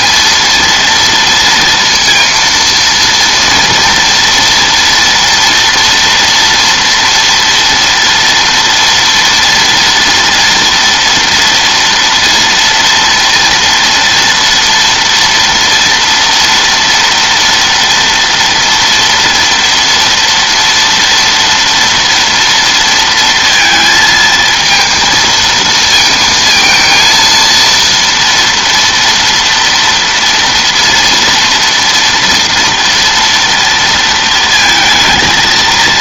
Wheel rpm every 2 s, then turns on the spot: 230, 230, 230, 230, 230, 230, 230, 230, 230, 230, 230, 230, 230, 230, 230, 230, 230, 220.
none